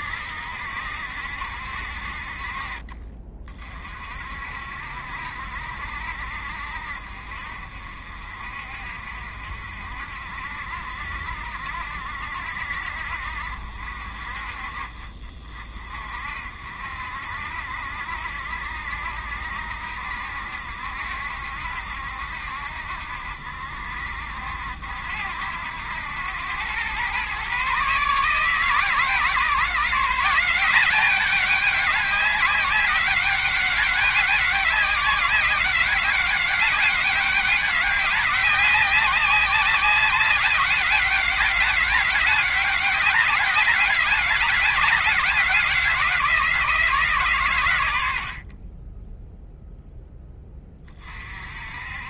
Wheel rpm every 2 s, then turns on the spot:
70, 40, 60, 60, 50, 60, 60, 40, 60, 70, 70, 70, 70, 110, 150, 190, 190, 190, 200, 190, 190, 190, 190, 160, 20, 30.
none